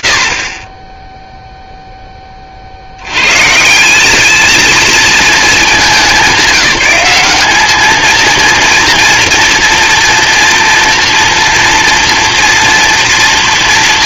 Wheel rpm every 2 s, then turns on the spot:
90, 20, 200, 200, 230, 230, 230.
none